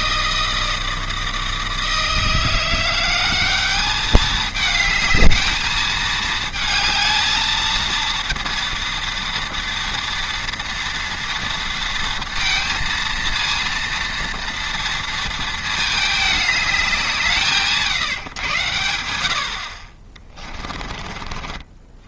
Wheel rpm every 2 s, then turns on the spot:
160, 190, 220, 220, 230, 230, 230, 230, 170, 70, 50.
none